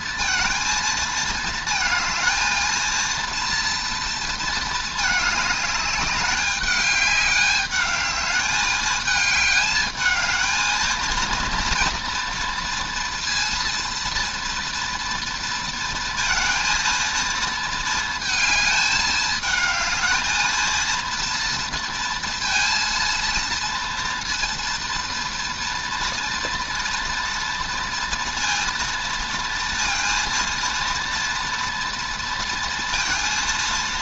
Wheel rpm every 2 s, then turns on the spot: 230, 230, 220, 200, 210, 220, 230, 230, 230, 220, 220, 230, 230, 230, 230, 230, 230.
none